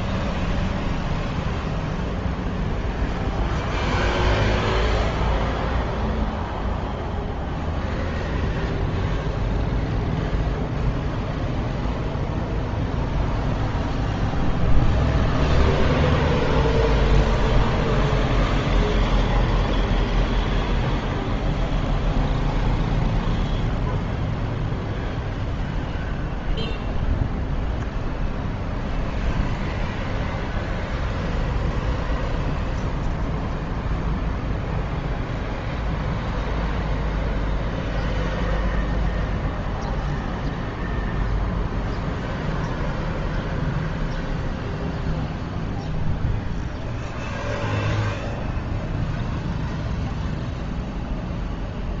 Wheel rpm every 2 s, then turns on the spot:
0, 0, 0, 0, 0, 0, 0, 0, 0, 0, 0, 0, 0, 0, 0, 0, 0, 0, 0, 0, 0, 0, 0, 0, 0, 0.
none